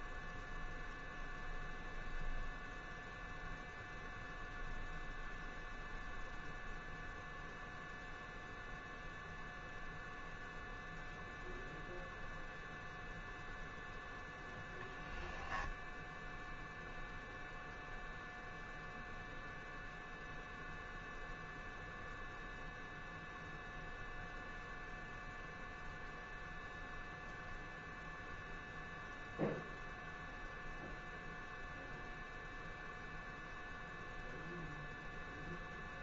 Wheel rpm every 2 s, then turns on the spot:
0, 0, 0, 0, 0, 0, 0, 0, 0, 0, 0, 0, 0, 0, 0, 0, 0, 0.
none